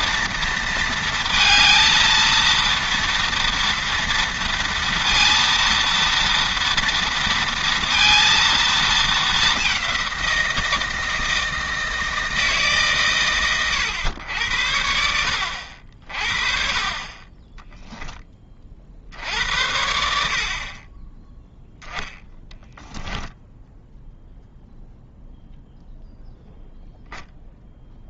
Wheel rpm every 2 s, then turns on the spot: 230, 230, 230, 230, 220, 160, 140, 70, 40, 40, 30, 10, 0, 0.
22-24